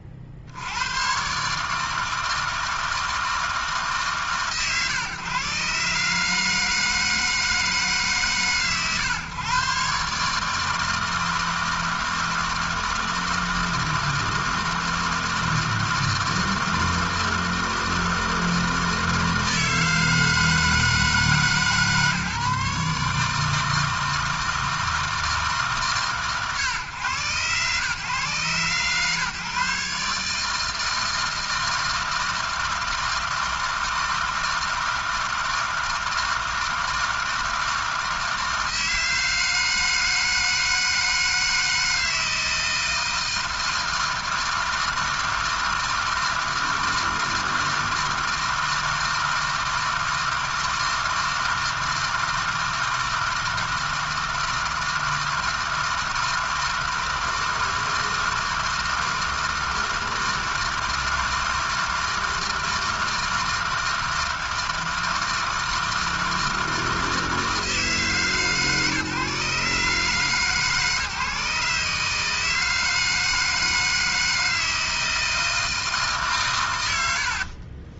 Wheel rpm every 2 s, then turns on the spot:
90, 160, 120, 160, 120, 160, 160, 160, 160, 160, 160, 150, 160, 120, 130, 160, 160, 160, 160, 160, 160, 160, 160, 160, 160, 160, 160, 160, 160, 160, 160, 160, 160, 160, 140, 150, 160, 160, 110.
76-78